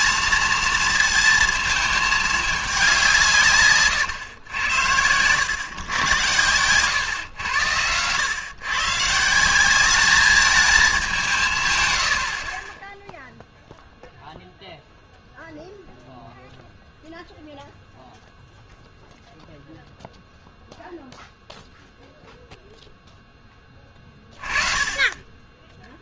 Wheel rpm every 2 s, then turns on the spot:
230, 200, 100, 110, 130, 210, 30, 0, 0, 0, 0, 0, 20.
none